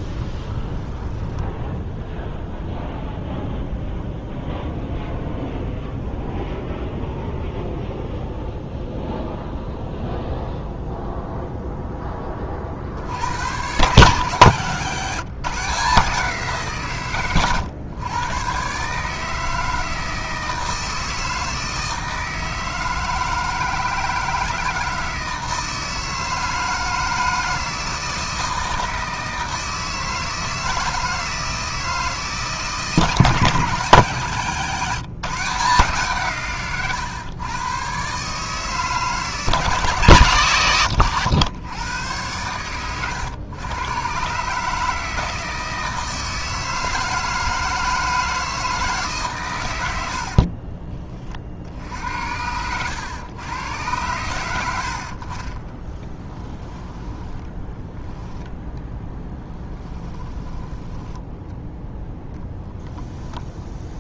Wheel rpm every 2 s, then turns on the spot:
10, 0, 0, 0, 0, 0, 50, 140, 150, 140, 160, 160, 160, 160, 160, 160, 160, 160, 120, 150, 100, 110, 150, 160, 160, 30, 100, 70, 10, 10, 10, 10.
0-2 14-16 50-52 56-60